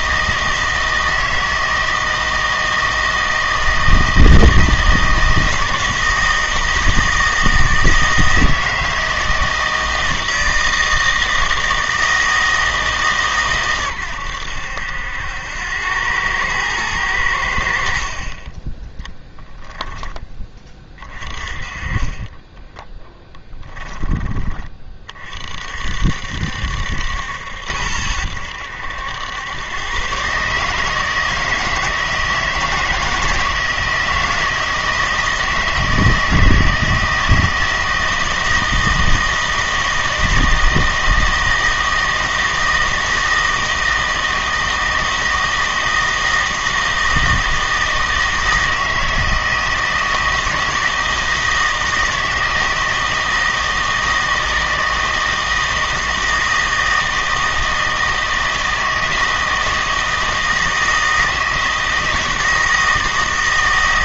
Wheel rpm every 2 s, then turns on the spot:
160, 160, 160, 160, 160, 160, 160, 80, 110, 10, 20, 10, 30, 70, 80, 150, 170, 160, 160, 160, 160, 160, 160, 160, 160, 160, 160, 160, 160, 160, 160, 160.
22-24